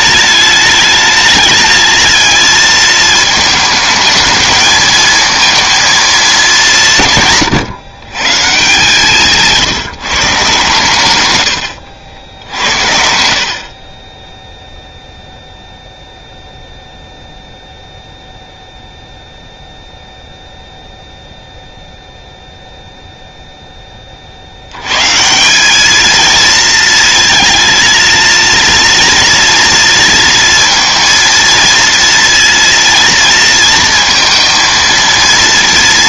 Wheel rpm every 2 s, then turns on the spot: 210, 220, 220, 200, 140, 140, 70, 0, 0, 0, 0, 0, 60, 230, 230, 230, 230, 230.
none